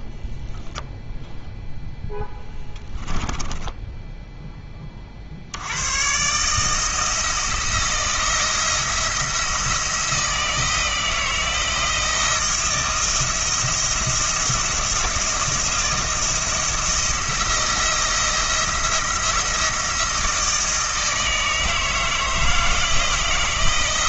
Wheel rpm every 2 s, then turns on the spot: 0, 10, 30, 160, 170, 160, 170, 170, 170, 170, 160, 160.
none